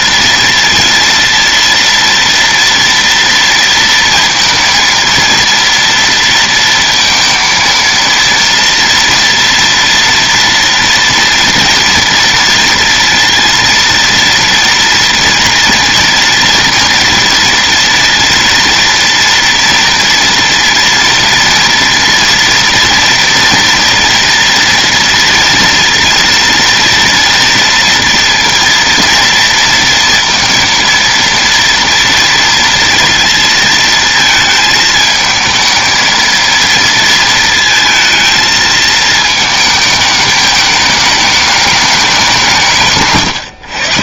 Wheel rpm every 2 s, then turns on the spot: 230, 230, 230, 230, 230, 230, 230, 230, 230, 240, 230, 230, 230, 230, 230, 230, 230, 220, 230, 220, 210, 190.
none